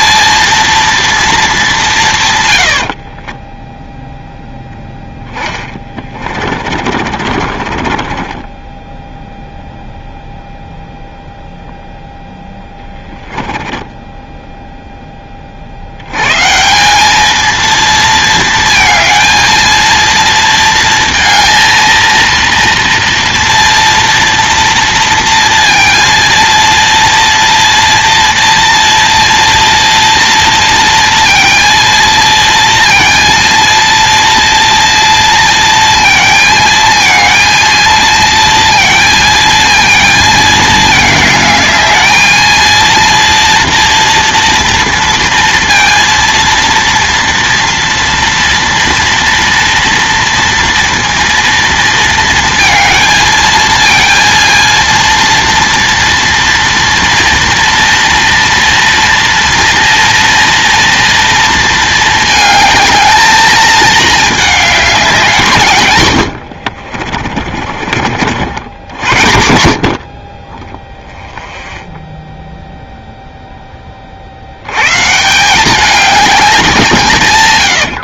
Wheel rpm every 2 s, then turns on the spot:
230, 90, 0, 40, 10, 0, 10, 10, 170, 220, 230, 230, 230, 230, 230, 230, 230, 230, 220, 230, 220, 230, 230, 230, 230, 230, 220, 230, 230, 230, 230, 220, 210, 70, 80, 10, 0, 100, 190.
2-4 6-10 12-14 66-70